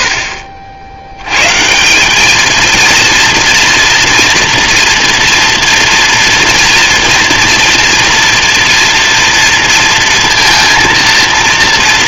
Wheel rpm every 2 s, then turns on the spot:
20, 210, 230, 230, 230, 230.
none